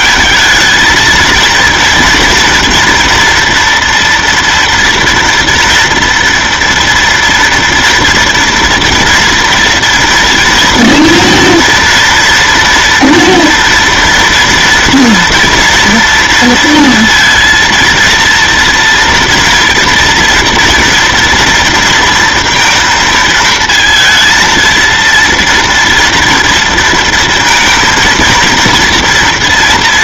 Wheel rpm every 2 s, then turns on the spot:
220, 230, 230, 230, 240, 230, 230, 230, 230, 230, 230, 230, 230, 230, 230.
none